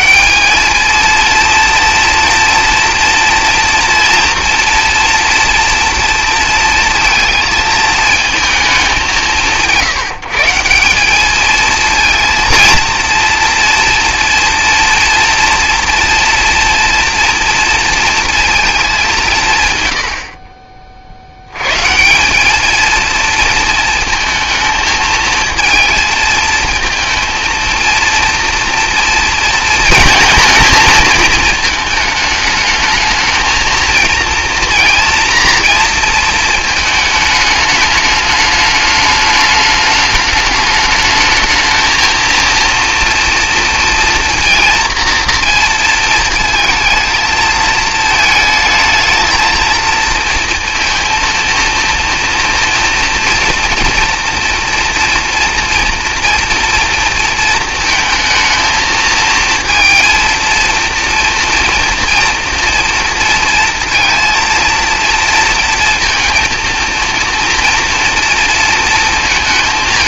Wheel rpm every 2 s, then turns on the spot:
220, 230, 230, 230, 200, 180, 230, 230, 230, 210, 40, 220, 220, 220, 230, 220, 220, 230, 220, 210, 210, 230, 230, 220, 220, 230, 240, 240, 230, 220, 230, 230, 230, 230, 230.
none